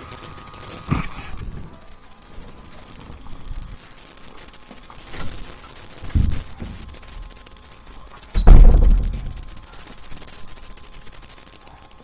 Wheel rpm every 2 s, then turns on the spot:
0, 0, 0, 0, 0, 0.
none